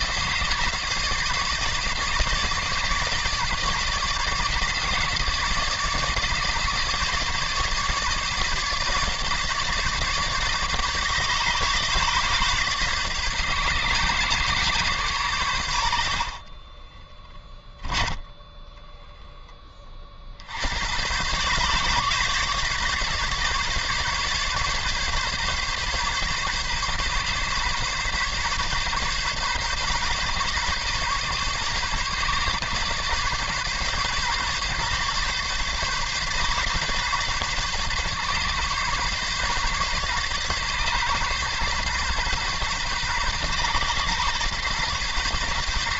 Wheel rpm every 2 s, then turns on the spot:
150, 150, 150, 150, 150, 150, 140, 140, 30, 10, 80, 140, 140, 140, 140, 140, 130, 140, 140, 140, 140, 130, 130.
16-20